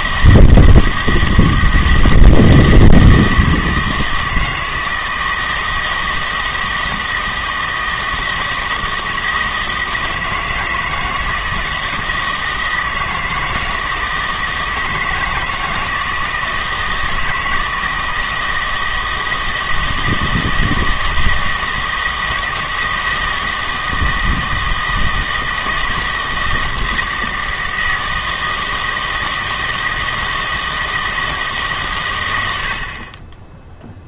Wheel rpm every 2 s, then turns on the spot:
160, 160, 160, 160, 160, 170, 160, 160, 160, 160, 160, 160, 160, 160, 160, 160, 90.
none